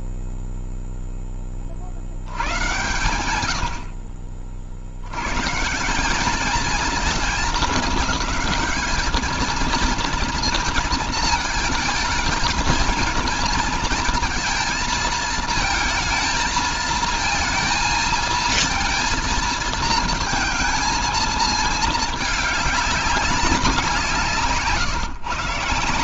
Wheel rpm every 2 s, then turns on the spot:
0, 100, 50, 220, 210, 230, 220, 230, 230, 230, 220, 210, 130.
none